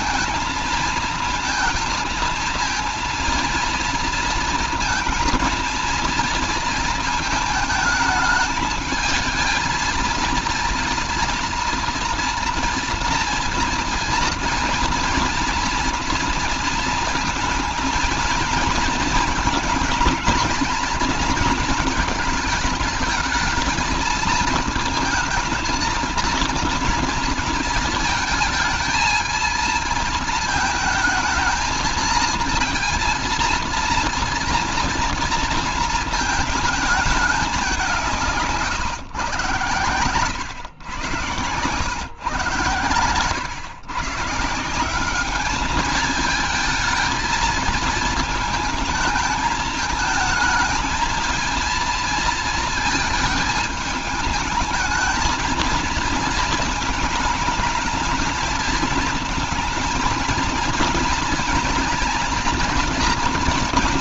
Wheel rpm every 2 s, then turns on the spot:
230, 230, 230, 230, 220, 230, 230, 230, 230, 230, 230, 220, 220, 230, 220, 220, 230, 230, 230, 150, 110, 120, 160, 220, 220, 220, 230, 220, 220, 220, 230, 230.
none